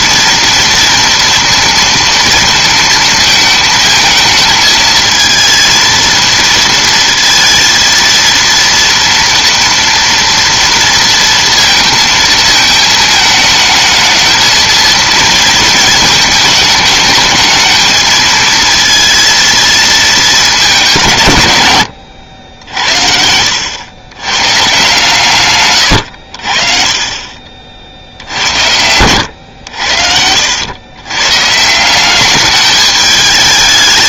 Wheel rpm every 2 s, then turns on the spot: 230, 230, 220, 230, 230, 230, 220, 230, 220, 220, 200, 70, 130, 60, 90, 80, 210.
none